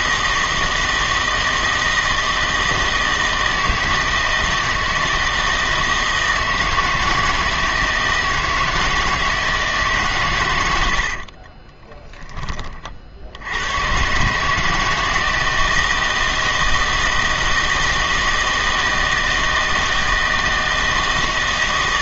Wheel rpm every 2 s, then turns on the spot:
160, 160, 160, 160, 160, 90, 40, 160, 160, 160, 160.
10-12